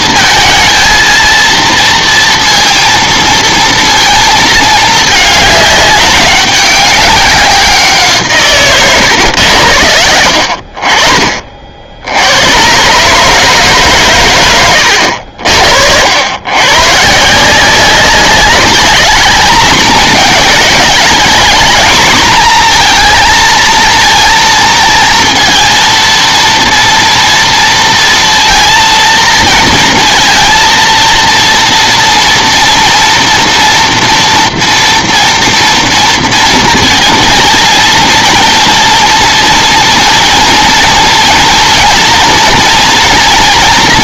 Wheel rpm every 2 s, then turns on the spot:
230, 230, 220, 200, 140, 50, 110, 100, 120, 200, 210, 230, 230, 230, 230, 230, 240, 230, 230, 230, 230, 240.
none